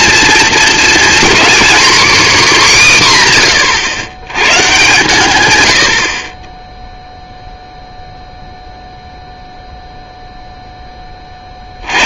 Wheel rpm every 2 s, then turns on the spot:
240, 250, 130, 20, 0, 0.
none